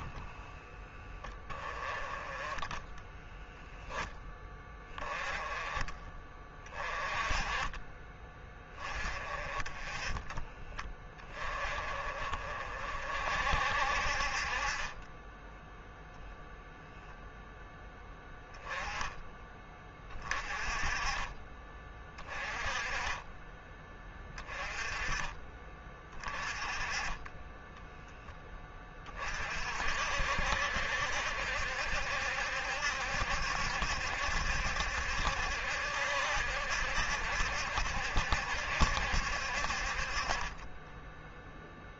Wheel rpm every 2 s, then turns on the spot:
20, 10, 10, 20, 20, 20, 40, 40, 0, 10, 30, 20, 20, 20, 20, 60, 70, 70, 70, 70, 30.
0-4 40-42